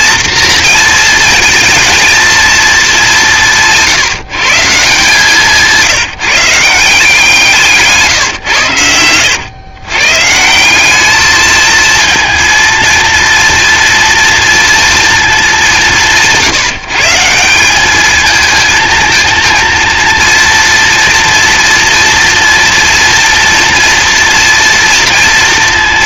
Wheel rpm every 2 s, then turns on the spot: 230, 210, 160, 170, 100, 180, 230, 230, 170, 220, 230, 230, 230.
none